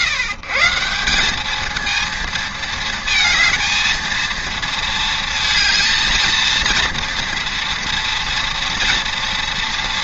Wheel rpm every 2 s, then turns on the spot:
140, 220, 220, 230, 230.
none